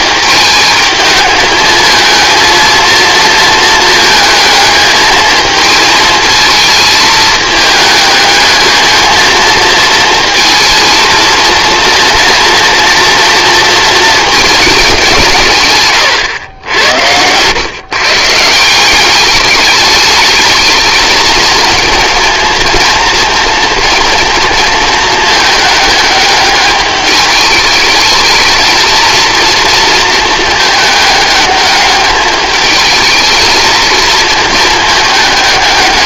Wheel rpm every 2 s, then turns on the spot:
220, 230, 220, 220, 220, 230, 230, 210, 90, 170, 220, 230, 220, 210, 230, 220, 210, 220.
none